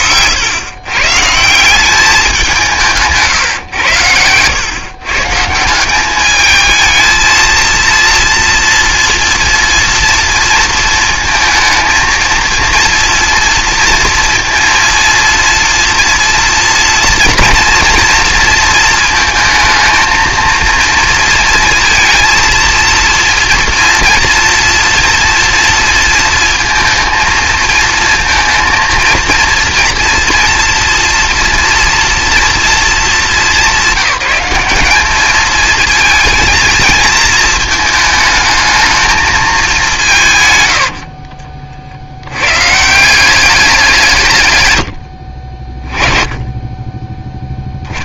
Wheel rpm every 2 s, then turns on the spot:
130, 170, 130, 220, 240, 230, 230, 230, 240, 230, 230, 230, 230, 230, 230, 230, 220, 200, 220, 220, 100, 150, 100, 20.
40-42